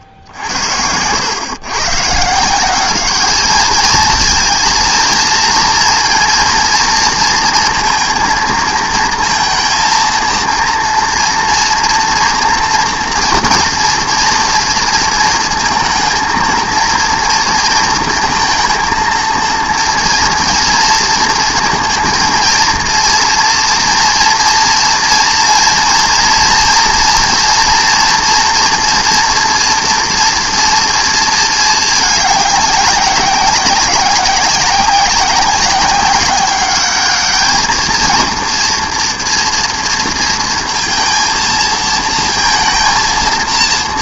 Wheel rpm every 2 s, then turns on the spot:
90, 190, 230, 230, 230, 230, 230, 230, 230, 230, 230, 230, 240, 240, 230, 240, 200, 190, 200, 230, 230, 230.
none